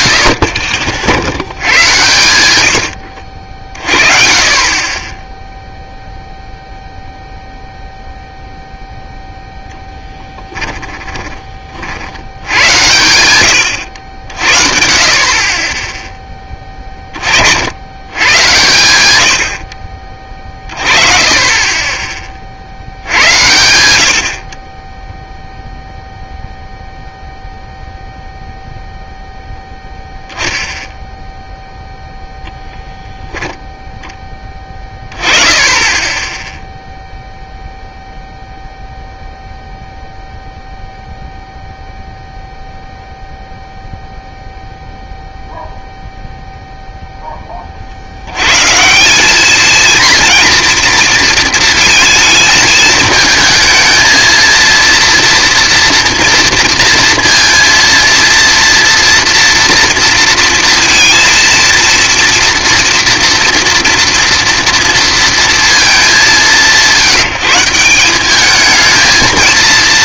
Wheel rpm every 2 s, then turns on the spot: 40, 90, 30, 0, 0, 10, 110, 50, 20, 100, 30, 70, 10, 0, 0, 0, 0, 10, 0, 0, 0, 0, 0, 0, 150, 230, 220, 230, 230, 230, 230, 230, 230, 150, 220.
10-12